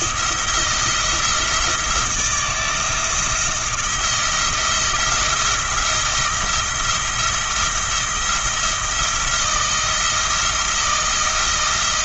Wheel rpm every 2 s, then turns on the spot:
170, 170, 170, 170, 170, 170.
none